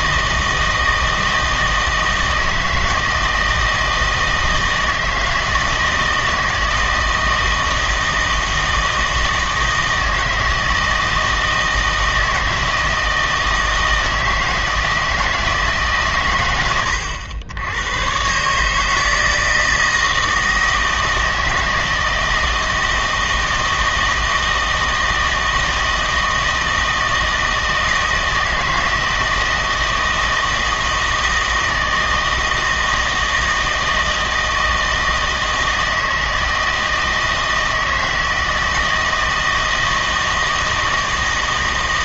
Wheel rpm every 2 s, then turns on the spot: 160, 160, 160, 160, 160, 160, 160, 160, 100, 150, 160, 160, 160, 160, 160, 160, 160, 160, 160, 160, 160.
none